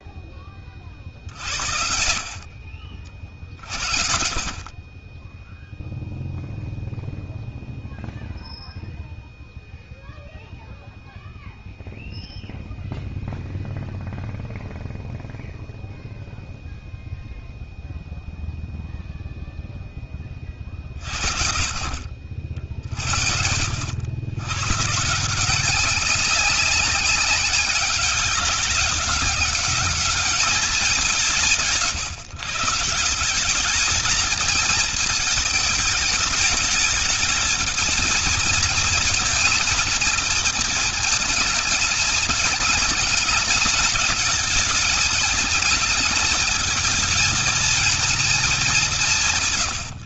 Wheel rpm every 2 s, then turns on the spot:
50, 50, 20, 0, 0, 0, 0, 0, 0, 0, 50, 50, 130, 190, 200, 180, 170, 220, 220, 220, 220, 210, 210, 220, 190.
none